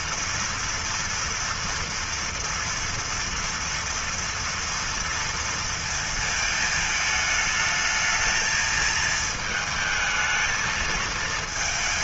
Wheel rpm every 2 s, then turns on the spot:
240, 230, 230, 220, 220, 220.
none